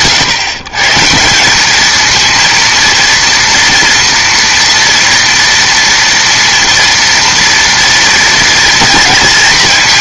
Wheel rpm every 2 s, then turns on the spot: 150, 230, 230, 230, 230.
none